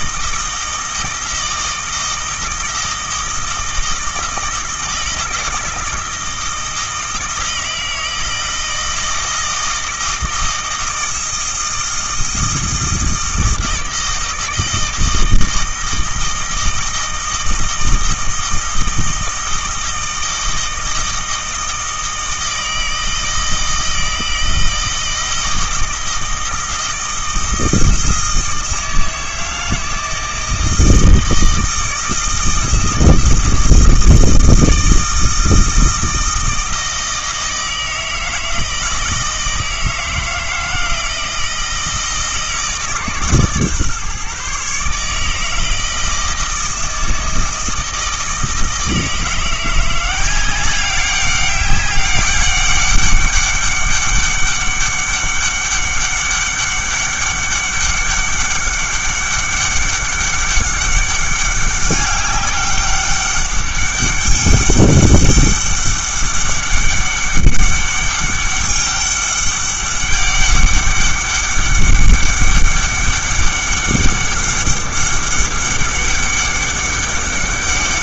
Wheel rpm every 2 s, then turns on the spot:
160, 160, 160, 160, 160, 160, 160, 160, 160, 160, 160, 160, 160, 160, 160, 160, 160, 160, 160, 160, 170, 150, 140, 160, 160, 190, 200, 200, 200, 200, 200, 200, 200, 200, 200, 200, 200, 200, 200.
none